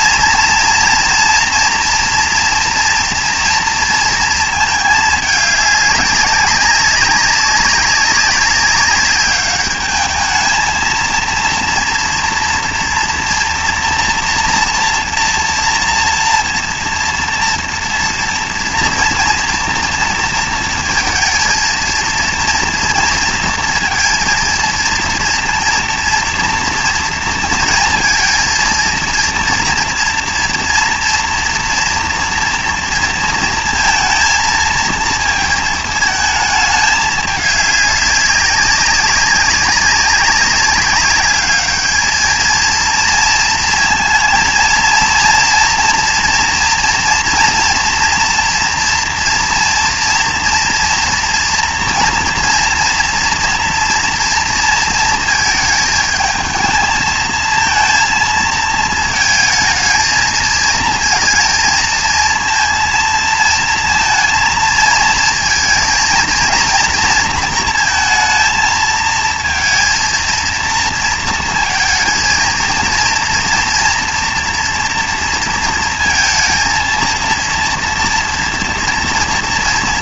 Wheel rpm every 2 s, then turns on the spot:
230, 230, 220, 200, 200, 220, 230, 230, 230, 230, 230, 230, 230, 230, 230, 230, 230, 230, 210, 190, 200, 230, 230, 230, 230, 230, 230, 230, 220, 220, 230, 230, 220, 230, 230, 230, 230, 230, 220, 230.
none